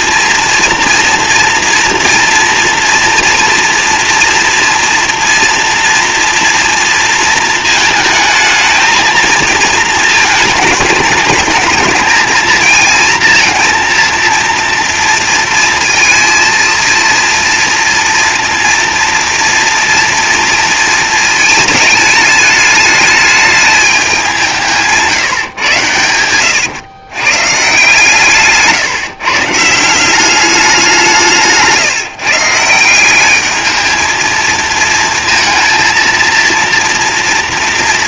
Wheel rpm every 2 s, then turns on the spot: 240, 230, 230, 240, 220, 220, 230, 230, 230, 240, 230, 210, 170, 110, 150, 190, 160, 230, 230.
none